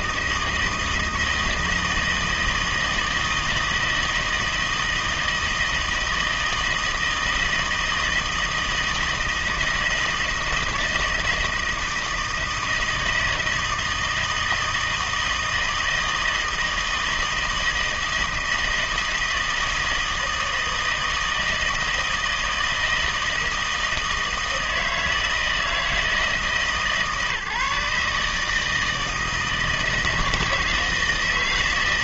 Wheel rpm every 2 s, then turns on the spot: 160, 160, 160, 160, 160, 160, 160, 160, 160, 160, 160, 160, 160, 150, 160, 160.
none